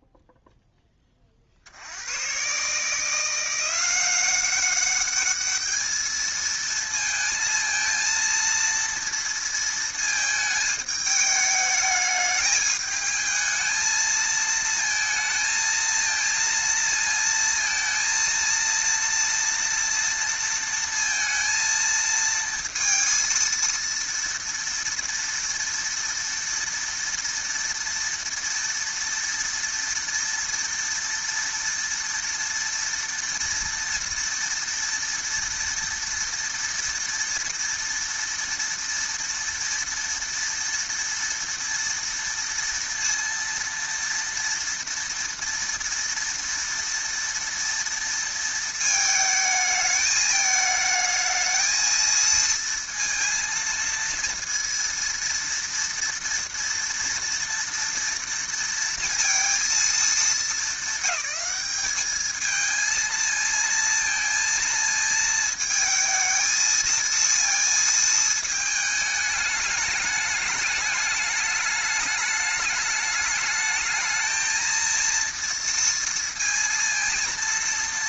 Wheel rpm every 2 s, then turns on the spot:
0, 120, 190, 220, 230, 220, 210, 220, 230, 230, 230, 230, 230, 230, 230, 230, 230, 230, 230, 230, 230, 230, 230, 230, 230, 210, 230, 230, 230, 230, 220, 220, 230, 220, 220, 210, 210, 220, 230.
none